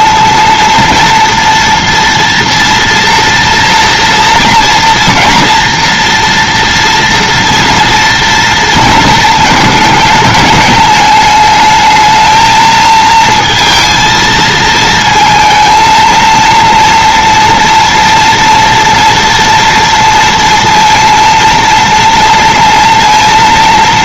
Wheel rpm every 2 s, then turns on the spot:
230, 230, 230, 230, 230, 210, 220, 220, 230, 230, 230, 230.
none